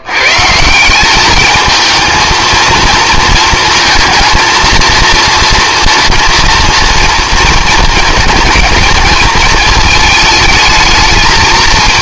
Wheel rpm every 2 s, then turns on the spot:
180, 220, 230, 230, 220, 220.
none